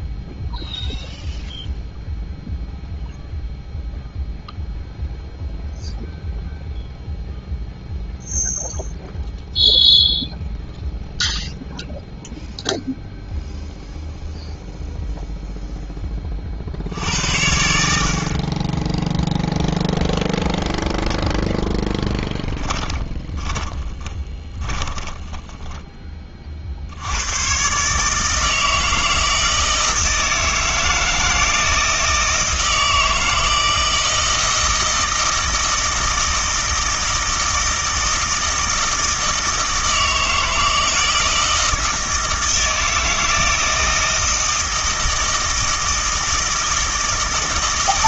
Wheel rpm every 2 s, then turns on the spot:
0, 0, 0, 0, 0, 0, 0, 0, 60, 10, 0, 10, 20, 50, 160, 160, 160, 160, 160, 160, 160, 160, 160, 160.
22-26